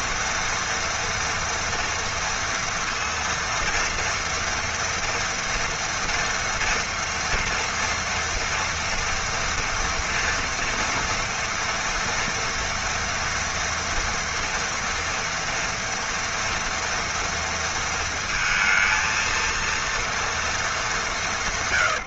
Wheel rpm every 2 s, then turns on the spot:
230, 230, 230, 230, 230, 240, 240, 230, 230, 230, 210.
none